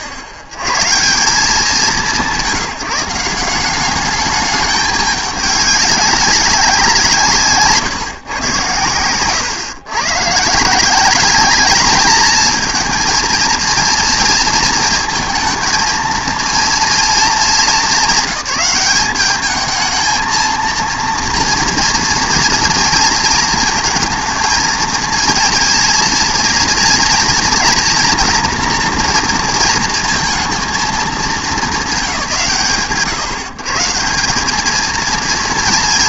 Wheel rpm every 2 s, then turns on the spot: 60, 170, 210, 190, 110, 170, 230, 230, 230, 200, 230, 230, 220, 240, 240, 230, 120, 210.
none